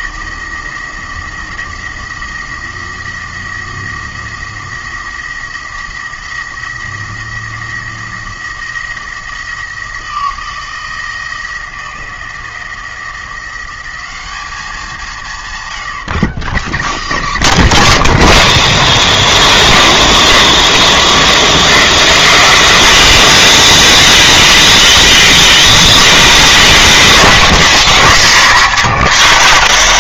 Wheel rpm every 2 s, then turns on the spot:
170, 170, 170, 170, 170, 170, 170, 200, 140, 40, 0, 0, 0, 0, 0.
none